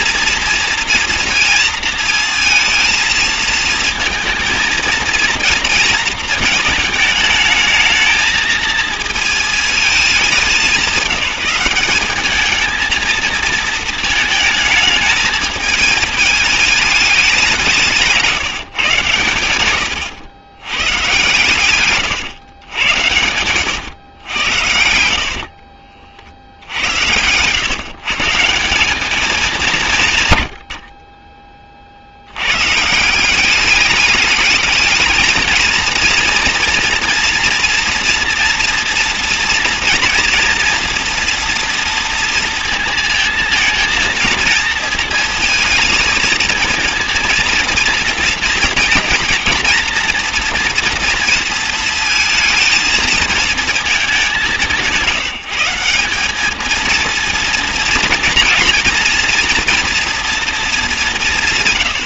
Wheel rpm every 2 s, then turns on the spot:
230, 230, 230, 220, 230, 200, 220, 220, 210, 150, 110, 110, 80, 90, 180, 80, 140, 220, 240, 230, 240, 230, 230, 230, 230, 230, 220, 150, 230, 240, 210.
24-28